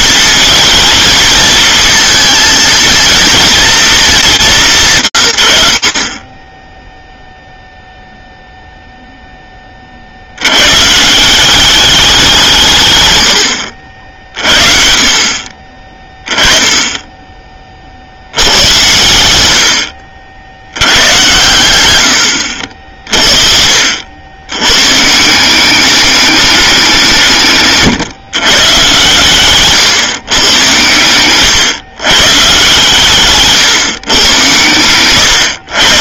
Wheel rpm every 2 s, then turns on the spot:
220, 230, 190, 10, 0, 110, 150, 40, 20, 100, 90, 70, 120, 180, 130, 110, 140, 110.
34-36